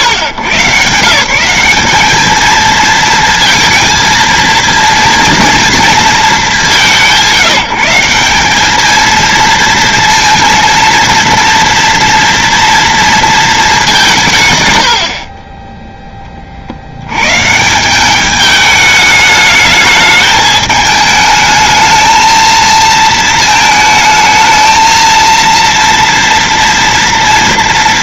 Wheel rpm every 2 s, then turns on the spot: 120, 220, 230, 200, 200, 230, 230, 110, 50, 210, 210, 220, 220, 230.
none